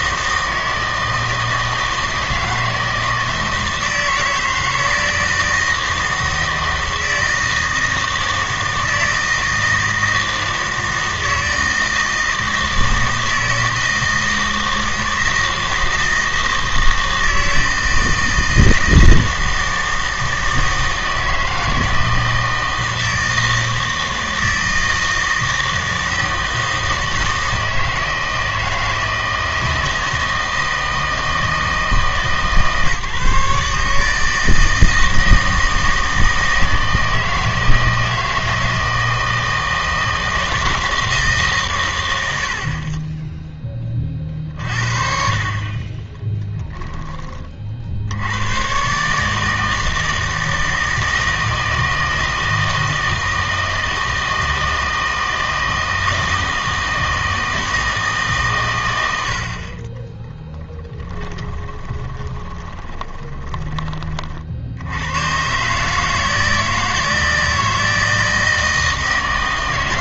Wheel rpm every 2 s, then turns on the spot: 160, 160, 160, 160, 160, 160, 160, 160, 160, 160, 160, 160, 160, 160, 160, 160, 140, 160, 160, 160, 170, 30, 40, 10, 120, 160, 160, 160, 160, 120, 10, 20, 70, 160, 160.
46-48 60-64